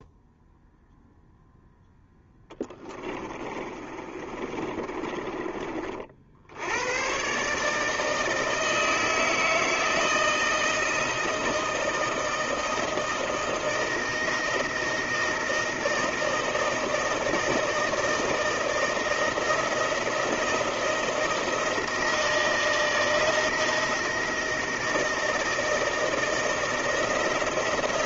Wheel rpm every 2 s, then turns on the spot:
0, 10, 30, 80, 160, 160, 160, 160, 160, 160, 170, 160, 160, 160.
2-6